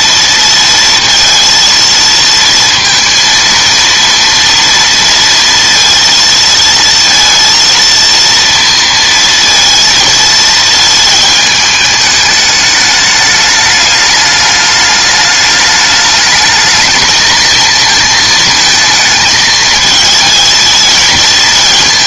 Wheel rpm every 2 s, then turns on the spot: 230, 230, 230, 230, 230, 230, 210, 210, 220, 220, 220.
none